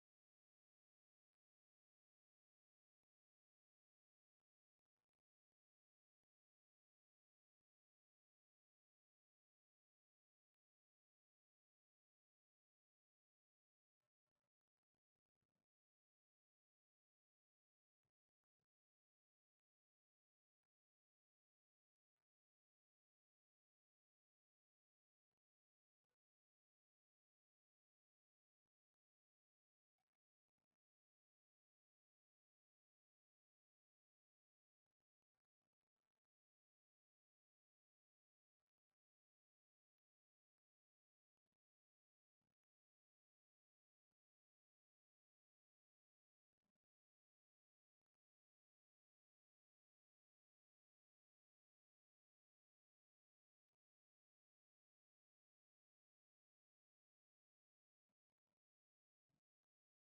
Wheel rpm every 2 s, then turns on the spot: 0, 0, 0, 0, 0, 0, 0, 0, 0, 0, 0, 0, 0, 0, 0, 0, 0, 0, 0, 0, 0, 0, 0, 0, 0, 0, 0, 0, 0, 0.
none